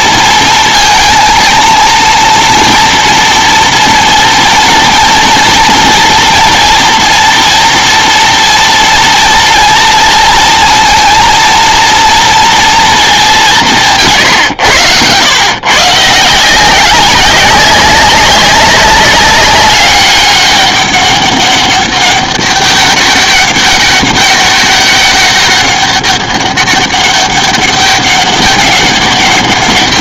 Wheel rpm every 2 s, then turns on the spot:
230, 230, 230, 240, 230, 230, 230, 110, 180, 200, 200, 200, 200, 200, 200.
none